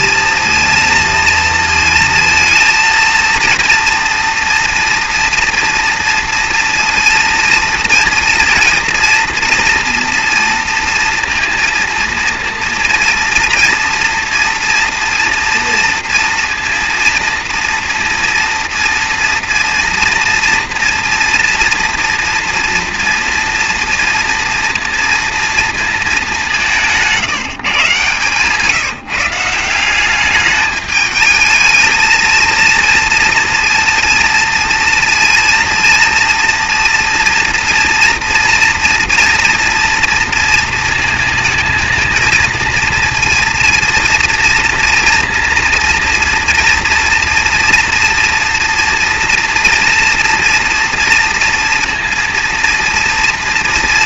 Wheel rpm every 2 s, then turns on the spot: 230, 220, 230, 230, 230, 230, 230, 240, 230, 230, 230, 230, 230, 200, 150, 210, 230, 230, 230, 230, 230, 230, 230, 230, 240, 230, 230.
none